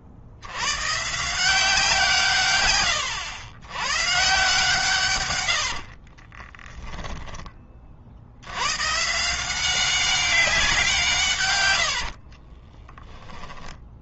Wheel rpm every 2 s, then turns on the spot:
130, 110, 130, 10, 130, 160, 10.
12-14